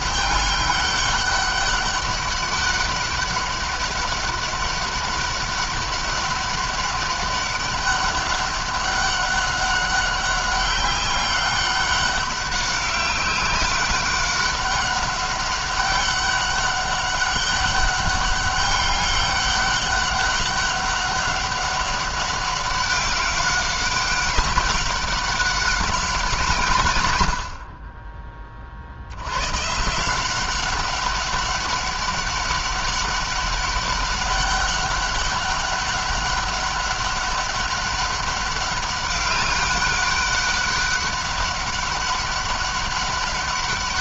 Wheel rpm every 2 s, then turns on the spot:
200, 200, 200, 200, 200, 190, 200, 200, 200, 200, 200, 190, 190, 160, 50, 190, 200, 200, 200, 200, 200, 200.
none